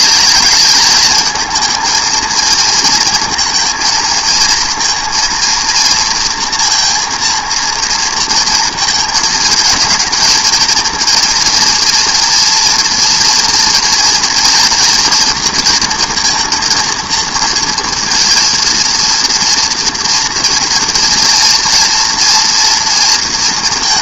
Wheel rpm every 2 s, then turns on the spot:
220, 230, 230, 230, 230, 230, 230, 230, 230, 230, 230, 230.
none